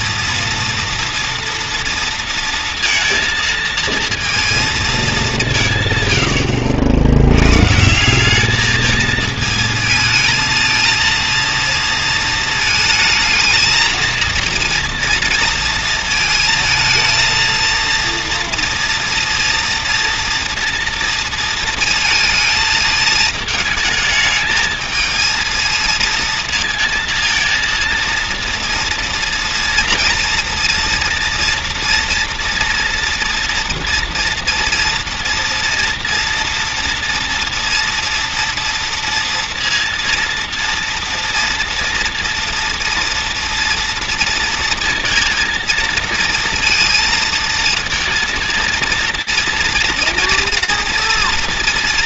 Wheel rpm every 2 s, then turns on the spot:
230, 230, 230, 80, 210, 230, 220, 230, 220, 230, 230, 220, 220, 230, 230, 230, 230, 230, 230, 230, 230, 230, 230, 230, 230, 230.
none